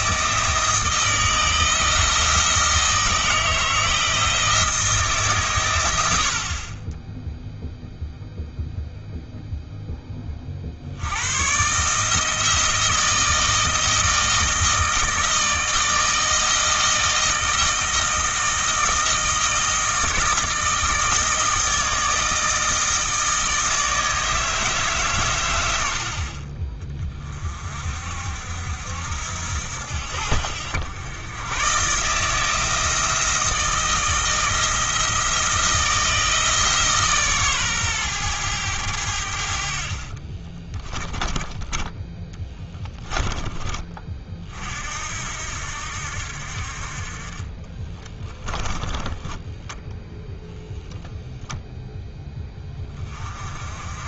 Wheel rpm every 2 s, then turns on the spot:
160, 160, 160, 20, 0, 50, 160, 160, 160, 160, 160, 160, 150, 30, 70, 90, 160, 160, 160, 100, 20, 10, 50, 50, 10, 0, 20.
40-42 48-50